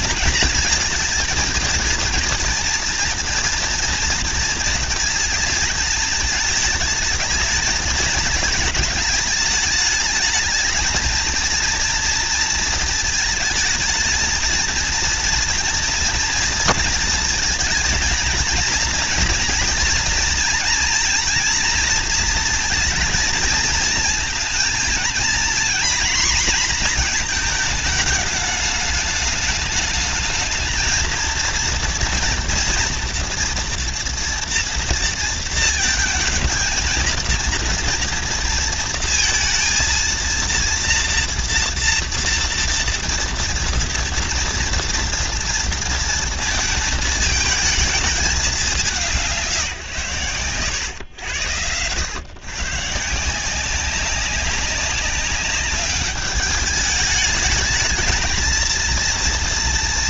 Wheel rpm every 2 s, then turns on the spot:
230, 230, 230, 220, 210, 220, 230, 230, 230, 230, 230, 230, 230, 240, 210, 220, 240, 230, 230, 230, 230, 230, 230, 230, 200, 120, 140, 200, 210, 230.
none